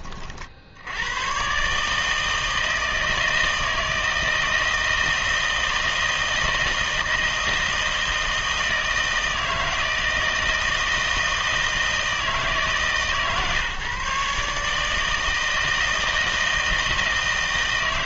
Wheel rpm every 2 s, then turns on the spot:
70, 160, 160, 160, 160, 160, 150, 150, 160.
none